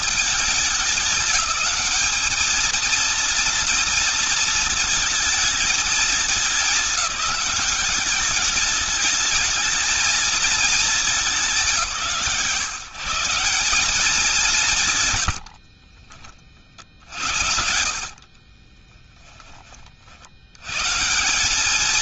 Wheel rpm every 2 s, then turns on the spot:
210, 220, 230, 210, 210, 220, 160, 140, 60, 20, 150.
14-20